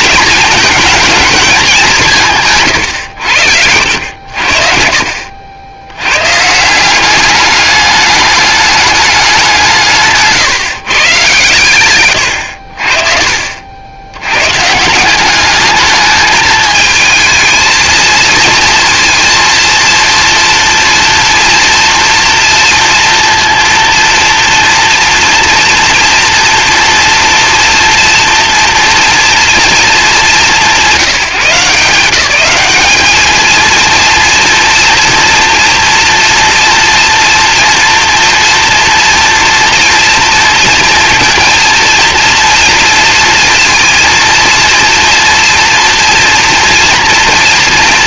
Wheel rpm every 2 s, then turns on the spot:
220, 130, 80, 180, 210, 130, 60, 140, 220, 230, 230, 230, 230, 230, 240, 180, 190, 230, 230, 230, 230, 230, 230, 230.
2-4